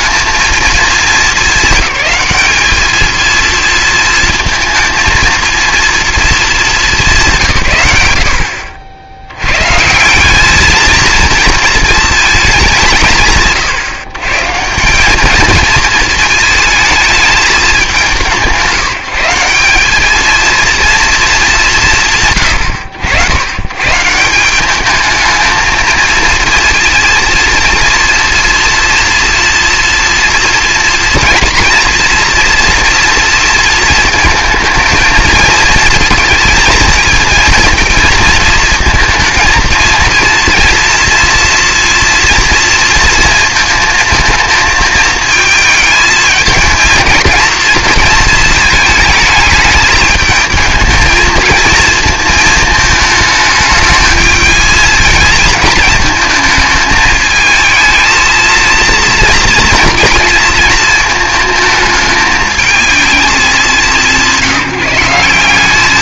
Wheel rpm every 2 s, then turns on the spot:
220, 220, 230, 210, 70, 220, 190, 170, 220, 170, 230, 100, 210, 230, 230, 230, 230, 230, 220, 220, 230, 230, 220, 220, 220, 220, 220, 220, 220, 230, 230, 220, 170.
none